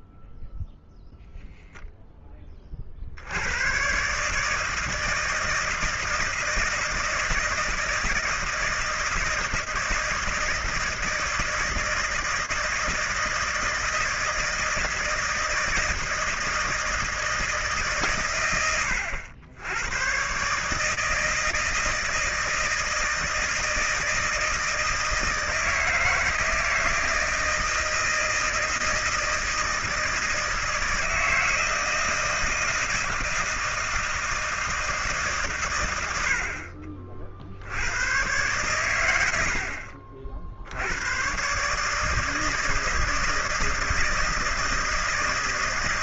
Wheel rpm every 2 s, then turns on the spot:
10, 20, 150, 160, 160, 160, 160, 160, 170, 80, 130, 160, 160, 160, 160, 160, 160, 160, 70, 110, 60, 160, 160.
none